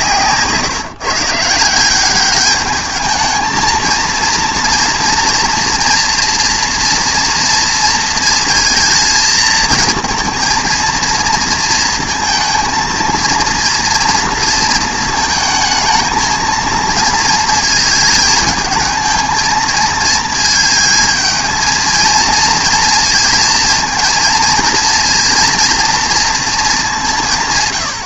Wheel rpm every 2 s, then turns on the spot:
150, 210, 230, 230, 220, 230, 230, 230, 230, 220, 220, 230, 230, 210.
none